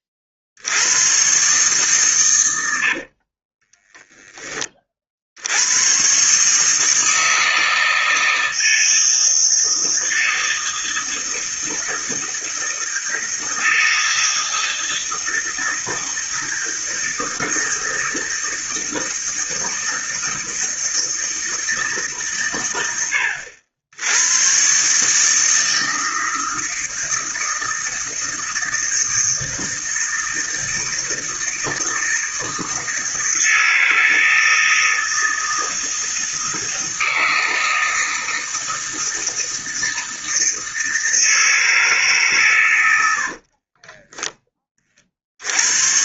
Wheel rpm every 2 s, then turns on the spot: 80, 90, 30, 150, 160, 160, 160, 160, 160, 160, 160, 110, 130, 160, 160, 160, 160, 160, 160, 160, 160, 120, 30.
2-4